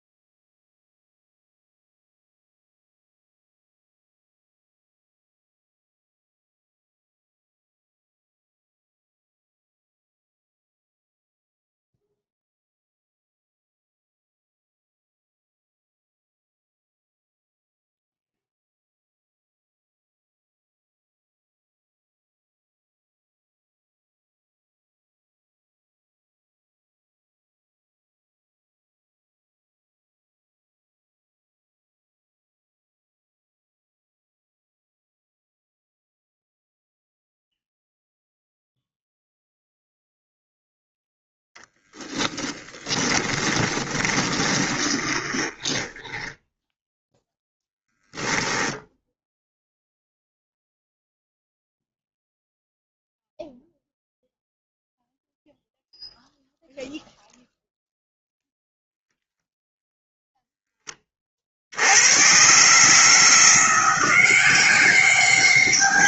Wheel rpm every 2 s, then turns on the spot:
0, 0, 0, 0, 0, 0, 0, 0, 0, 0, 0, 0, 0, 0, 0, 0, 0, 0, 0, 0, 0, 20, 20, 0, 0, 0, 0, 0, 0, 0, 10, 150, 190.
42-46